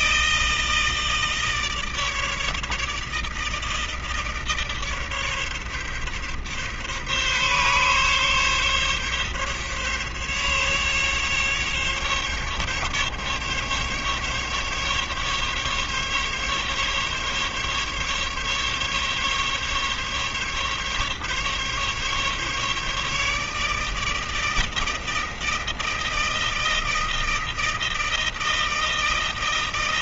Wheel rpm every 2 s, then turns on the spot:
160, 160, 150, 140, 140, 140, 140, 140, 140, 140, 140, 150, 160, 160, 160.
none